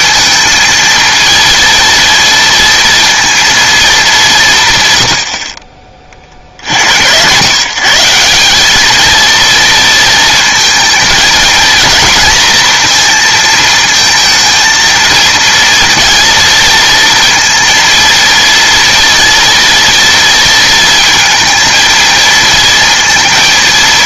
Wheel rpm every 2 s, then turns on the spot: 230, 230, 150, 80, 210, 230, 230, 230, 230, 230, 230, 230.
none